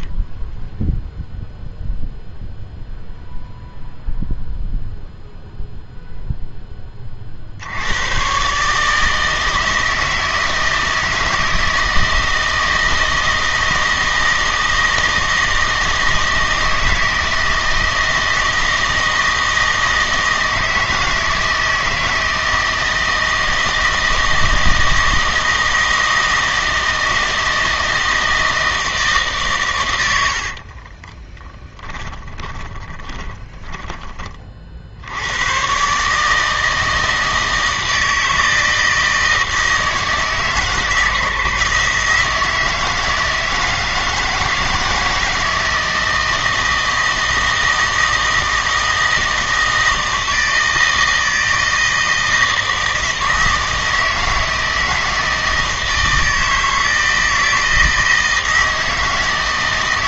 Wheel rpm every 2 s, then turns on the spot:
0, 0, 0, 10, 140, 160, 160, 160, 160, 160, 160, 160, 160, 160, 160, 50, 10, 50, 160, 160, 150, 160, 160, 160, 160, 160, 160, 160, 160, 160.
30-34